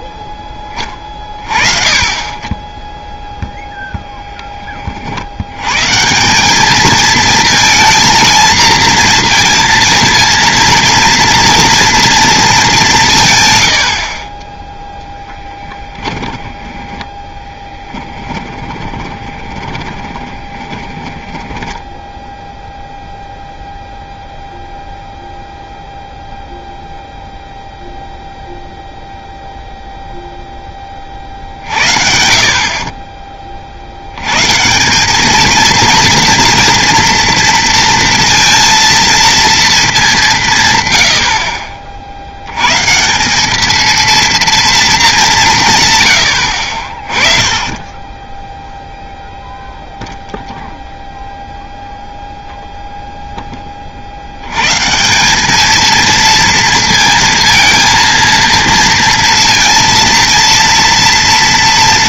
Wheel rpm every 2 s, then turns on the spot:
20, 10, 20, 210, 230, 230, 190, 0, 10, 20, 20, 0, 0, 0, 0, 30, 30, 160, 230, 230, 130, 130, 220, 40, 0, 0, 0, 140, 230, 230, 230.
0-2 16-22